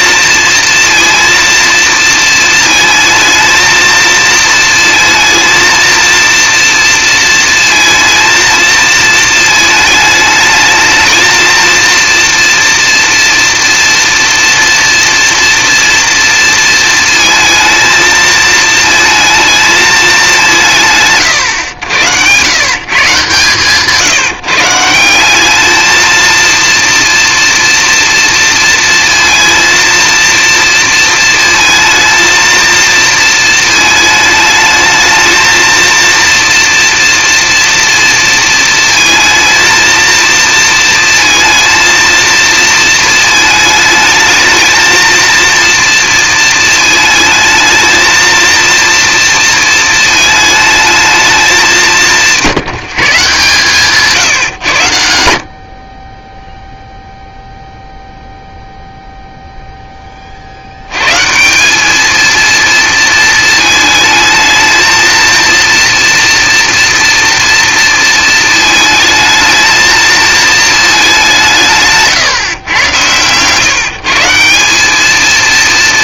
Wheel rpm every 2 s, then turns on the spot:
230, 220, 230, 230, 230, 220, 230, 230, 230, 220, 120, 130, 160, 230, 230, 230, 230, 220, 230, 230, 230, 230, 220, 220, 230, 220, 170, 120, 0, 0, 70, 230, 220, 230, 220, 220, 130, 180.
none